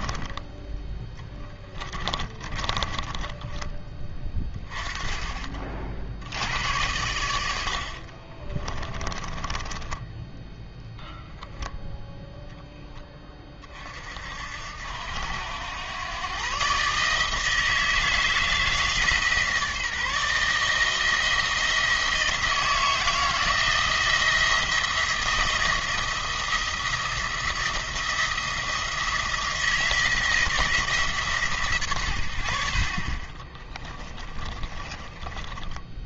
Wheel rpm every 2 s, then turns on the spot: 10, 20, 10, 90, 20, 0, 10, 70, 140, 160, 160, 160, 160, 170, 170, 160, 50, 30.
0-4 8-10 34-36